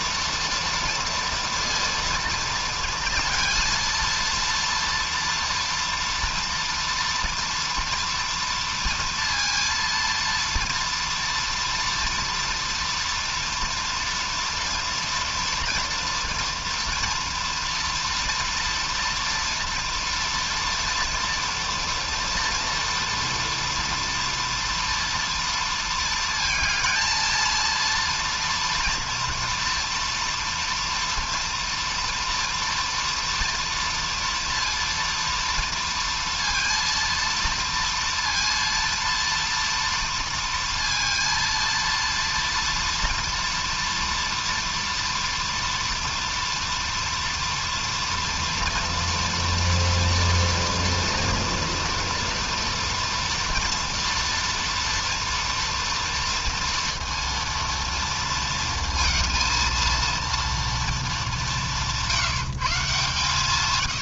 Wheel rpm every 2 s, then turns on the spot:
230, 230, 230, 230, 230, 230, 230, 230, 230, 230, 240, 230, 230, 230, 230, 230, 230, 230, 230, 230, 230, 230, 240, 240, 230, 230, 230, 230, 230, 230, 230, 160.
none